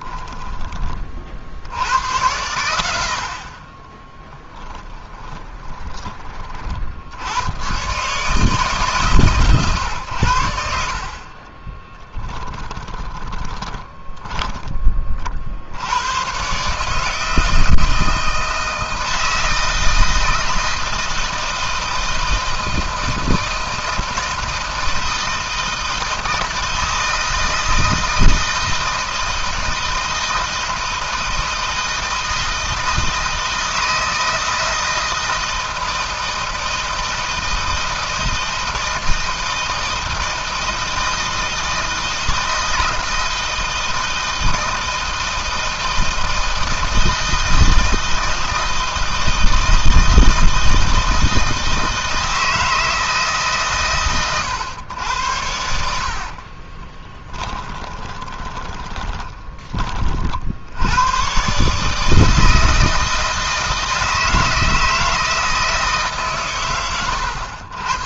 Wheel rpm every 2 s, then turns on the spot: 20, 90, 10, 60, 140, 60, 10, 30, 140, 160, 160, 160, 160, 160, 160, 160, 160, 160, 160, 160, 160, 160, 160, 160, 160, 160, 160, 100, 30, 20, 90, 160, 160, 120.
4-6 12-14 56-60